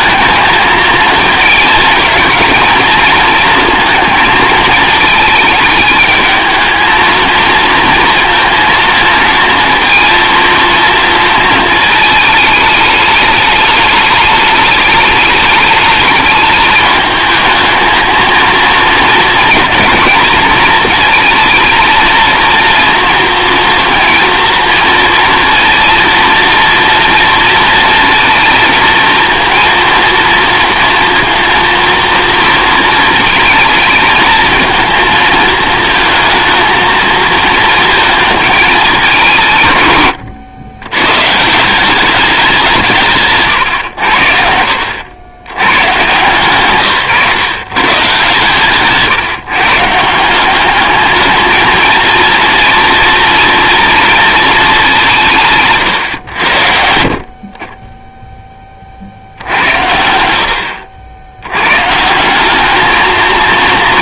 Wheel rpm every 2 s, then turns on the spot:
230, 230, 220, 220, 230, 230, 210, 210, 220, 230, 220, 230, 230, 230, 230, 230, 230, 220, 220, 220, 120, 180, 80, 140, 140, 200, 230, 210, 80, 20, 80, 200.
none